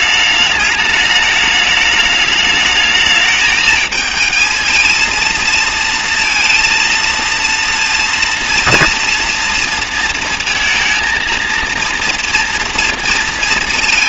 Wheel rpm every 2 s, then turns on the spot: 210, 210, 220, 230, 230, 230, 240.
none